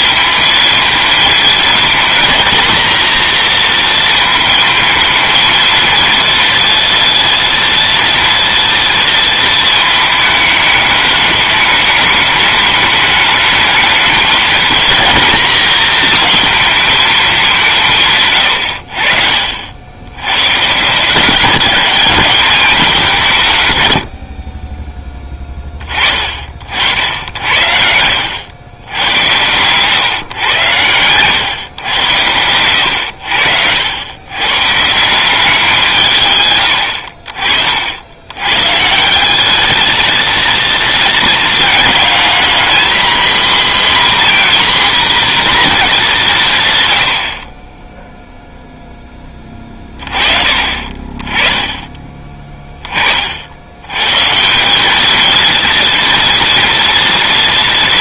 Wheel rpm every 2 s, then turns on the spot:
230, 230, 230, 230, 230, 210, 210, 230, 230, 90, 140, 190, 30, 70, 100, 110, 100, 130, 110, 130, 220, 230, 250, 140, 0, 40, 20, 190, 230.
none